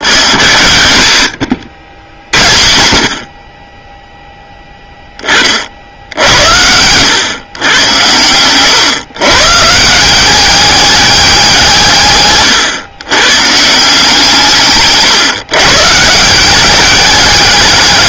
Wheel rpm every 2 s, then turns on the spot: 100, 60, 10, 90, 120, 200, 120, 150, 190.
none